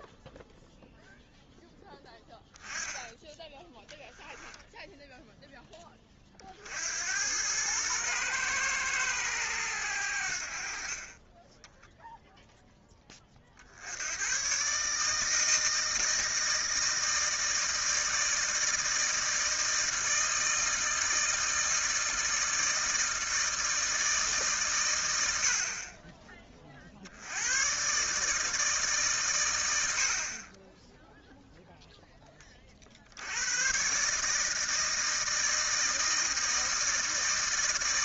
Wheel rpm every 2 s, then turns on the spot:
0, 10, 0, 50, 120, 50, 10, 130, 160, 160, 160, 160, 130, 30, 150, 20, 40, 160, 160.
none